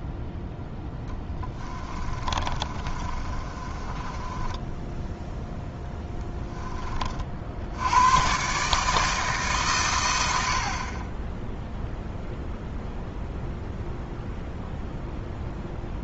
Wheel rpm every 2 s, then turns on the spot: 20, 30, 10, 20, 150, 40, 0, 0.
2-6